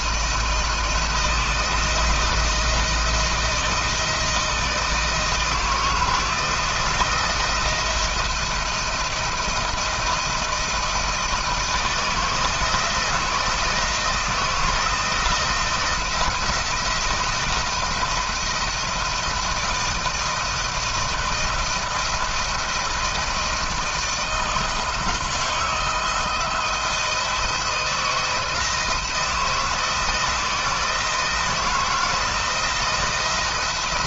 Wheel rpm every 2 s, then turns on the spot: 160, 170, 160, 160, 170, 160, 160, 160, 170, 170, 170, 170, 160, 170, 160, 160, 170.
none